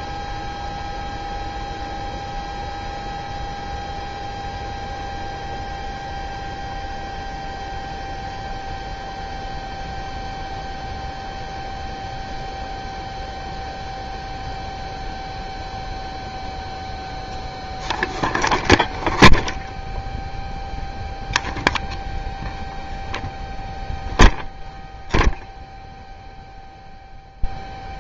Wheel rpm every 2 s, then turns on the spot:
0, 0, 0, 0, 0, 0, 0, 0, 0, 0, 0, 0, 0, 0.
none